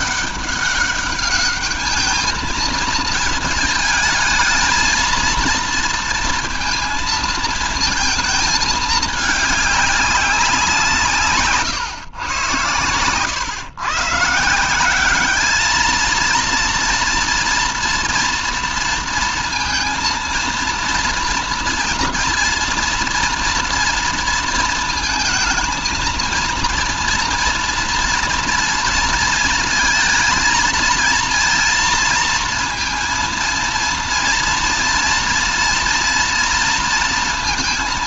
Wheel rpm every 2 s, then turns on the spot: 210, 220, 220, 230, 220, 170, 120, 180, 230, 230, 230, 230, 220, 230, 230, 230, 230, 230, 230.
12-14